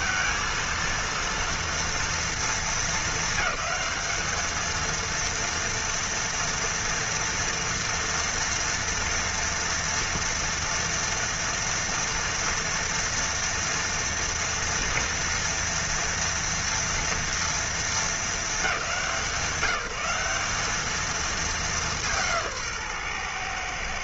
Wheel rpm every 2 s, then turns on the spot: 220, 220, 220, 240, 240, 230, 230, 230, 230, 220, 200, 160.
none